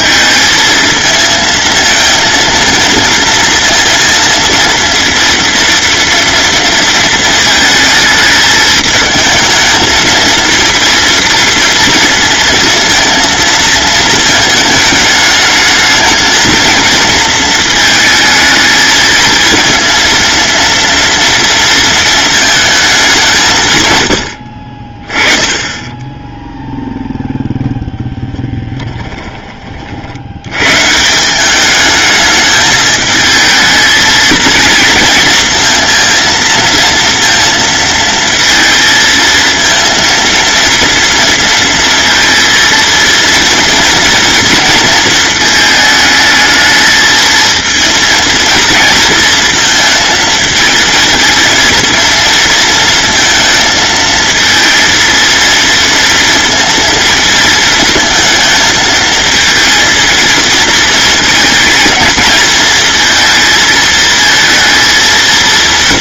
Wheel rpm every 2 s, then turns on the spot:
220, 230, 230, 230, 220, 230, 230, 210, 220, 220, 230, 200, 30, 0, 20, 150, 220, 230, 230, 220, 230, 230, 230, 220, 230, 220, 220, 230, 220, 220, 230, 230, 220.
28-30